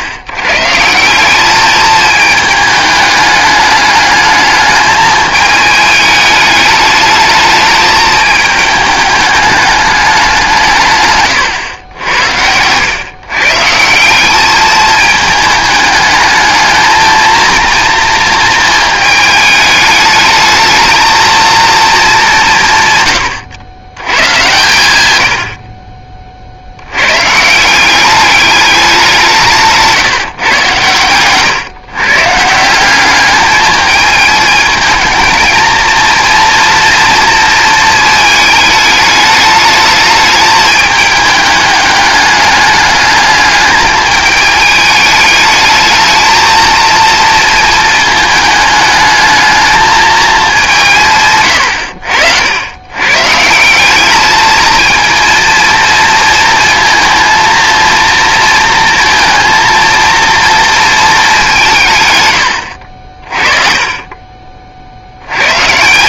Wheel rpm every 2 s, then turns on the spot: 150, 210, 210, 210, 210, 160, 100, 210, 220, 220, 220, 160, 120, 90, 200, 130, 170, 220, 230, 210, 210, 210, 210, 230, 210, 170, 100, 220, 230, 230, 230, 70, 50.
none